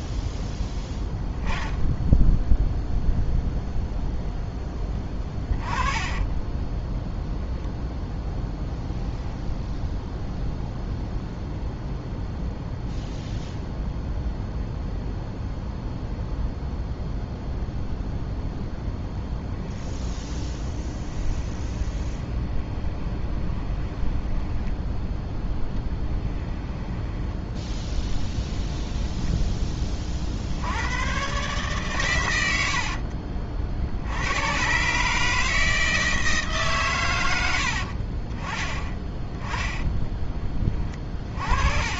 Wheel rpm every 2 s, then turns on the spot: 10, 0, 10, 0, 0, 0, 0, 0, 0, 0, 20, 20, 10, 10, 10, 100, 60, 140, 130, 10, 30.
4-6 20-24 26-28 32-34 40-42